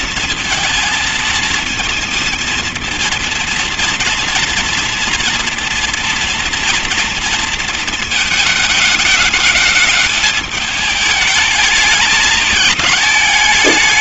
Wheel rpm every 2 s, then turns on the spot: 230, 230, 230, 240, 210, 210, 210.
none